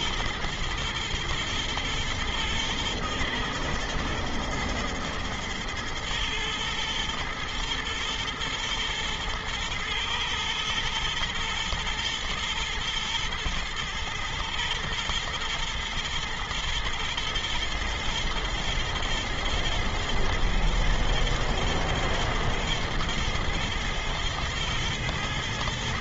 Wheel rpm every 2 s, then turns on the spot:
120, 120, 110, 110, 120, 110, 120, 110, 120, 110, 110, 120, 120.
none